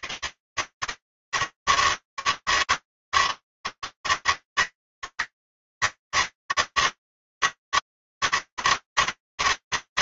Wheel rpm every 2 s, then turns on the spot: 140, 160, 160, 160, 150.
none